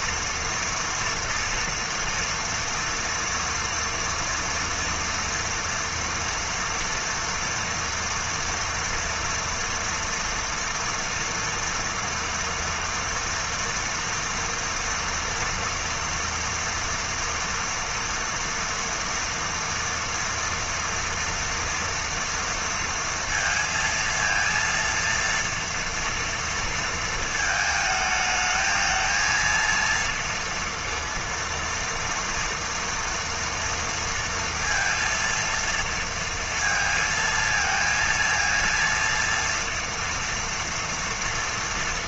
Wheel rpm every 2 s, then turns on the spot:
230, 240, 230, 240, 230, 230, 230, 240, 240, 230, 230, 230, 230, 230, 230, 230, 230, 230, 230, 230, 230.
none